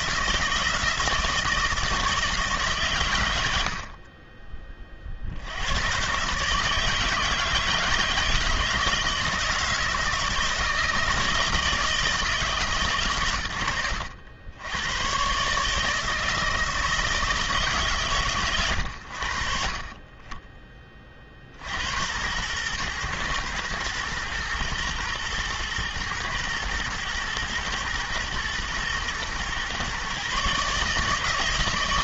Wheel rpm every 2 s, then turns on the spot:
160, 130, 40, 150, 160, 160, 150, 110, 160, 100, 30, 120, 120, 110, 120, 150.
none